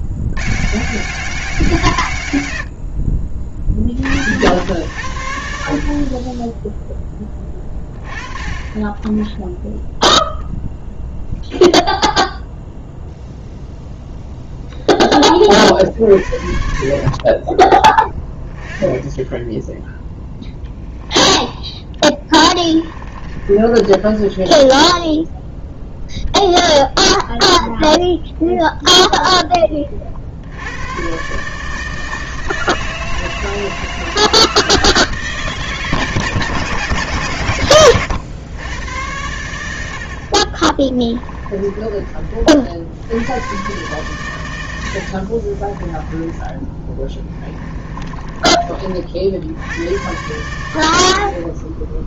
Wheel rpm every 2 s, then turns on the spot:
120, 100, 80, 10, 20, 0, 0, 0, 50, 10, 10, 20, 20, 0, 0, 70, 160, 160, 150, 100, 40, 50, 110, 20, 30, 90.
22-26 46-48